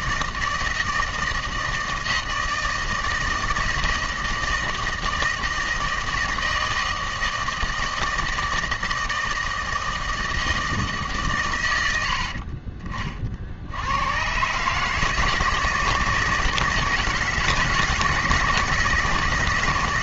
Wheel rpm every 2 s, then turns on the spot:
160, 160, 160, 160, 160, 160, 40, 140, 160, 160.
none